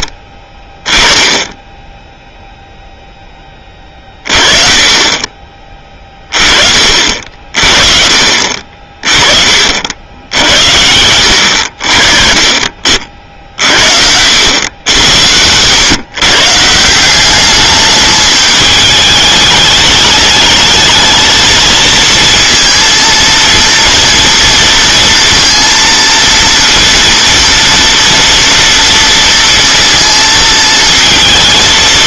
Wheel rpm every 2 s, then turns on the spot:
20, 0, 30, 40, 40, 70, 40, 100, 160, 210, 220, 230, 230, 230, 230, 220.
none